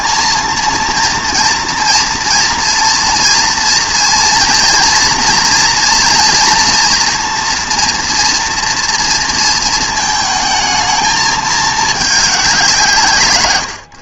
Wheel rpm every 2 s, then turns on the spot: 230, 230, 230, 230, 230, 220, 180.
none